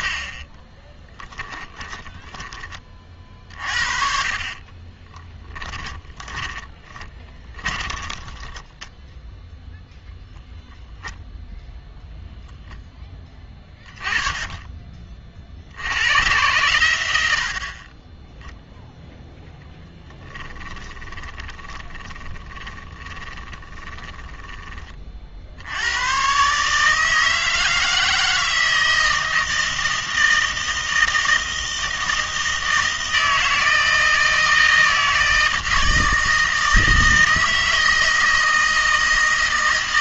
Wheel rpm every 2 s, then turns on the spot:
20, 30, 30, 20, 10, 0, 0, 30, 110, 0, 20, 20, 20, 150, 160, 160, 160, 160, 160, 160.
0-2 4-10 20-24